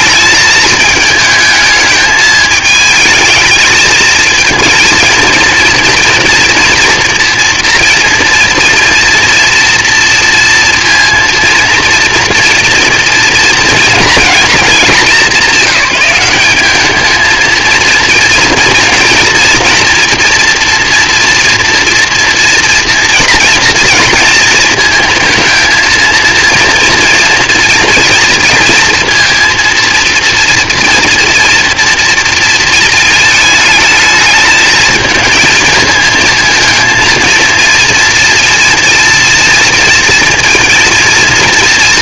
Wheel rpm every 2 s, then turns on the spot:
210, 220, 230, 230, 230, 230, 230, 230, 200, 230, 230, 230, 230, 230, 230, 230, 230, 220, 220, 230, 230.
none